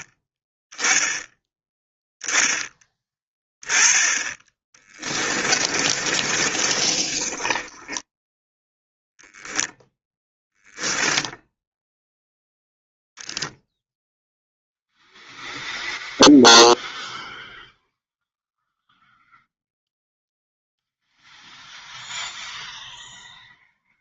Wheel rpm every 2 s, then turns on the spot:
10, 10, 20, 30, 0, 0, 0, 0, 0, 0, 0, 0.
4-8